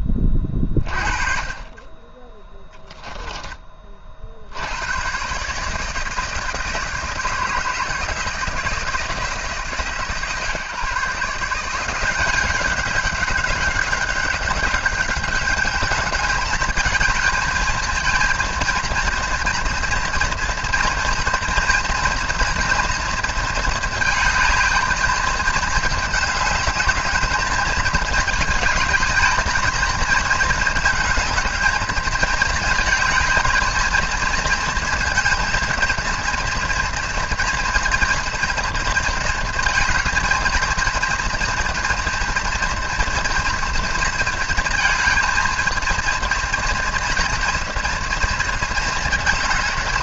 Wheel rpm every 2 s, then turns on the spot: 30, 10, 100, 160, 160, 150, 190, 200, 220, 230, 230, 230, 220, 210, 220, 220, 220, 230, 240, 230, 230, 240, 230, 230, 220.
none